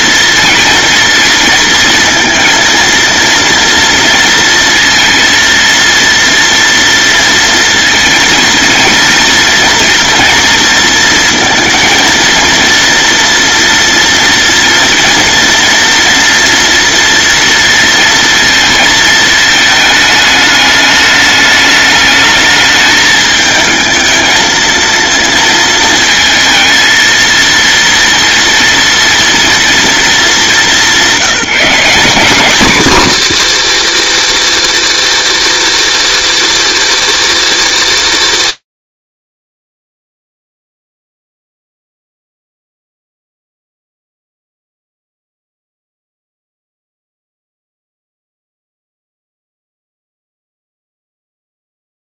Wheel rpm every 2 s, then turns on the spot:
230, 230, 230, 230, 230, 230, 230, 230, 230, 220, 210, 220, 230, 230, 230, 190, 300, 360, 360, 230, 0, 0, 0, 0, 0, 0.
none